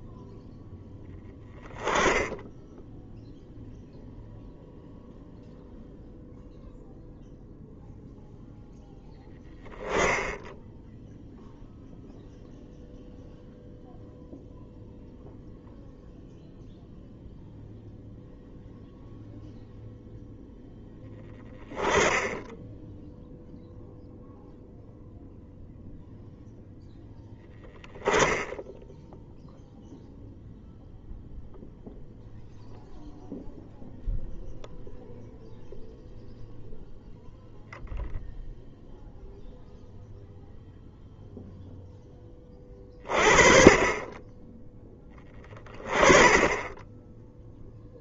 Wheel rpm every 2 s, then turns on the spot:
0, 0, 0, 0, 0, 0, 0, 0, 0, 0, 0, 0, 0, 0, 10, 0, 0, 0, 0, 0, 0, 20, 10, 10.
none